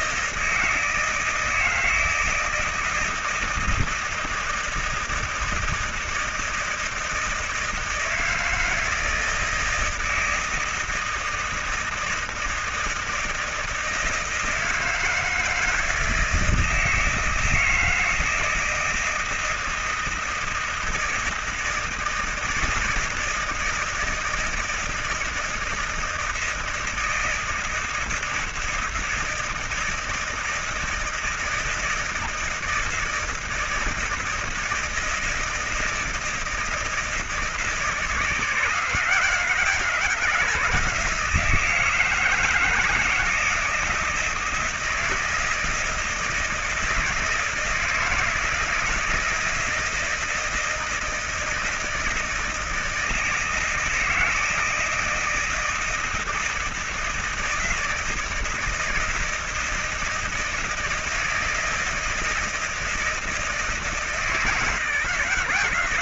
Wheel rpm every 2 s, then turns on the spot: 160, 160, 160, 160, 160, 160, 160, 160, 160, 160, 160, 160, 160, 160, 170, 160, 160, 160, 160, 160, 170, 160, 160, 160, 160, 160, 160, 160, 160, 160, 160, 160, 160.
none